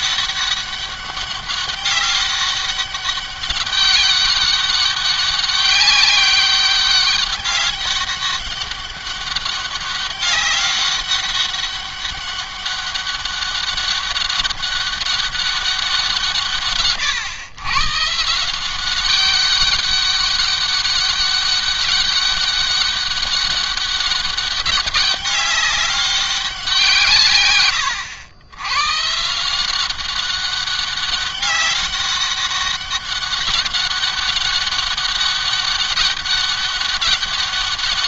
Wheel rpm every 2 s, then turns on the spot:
200, 200, 200, 200, 200, 200, 200, 200, 150, 170, 200, 200, 200, 190, 110, 190, 200, 200, 200.
none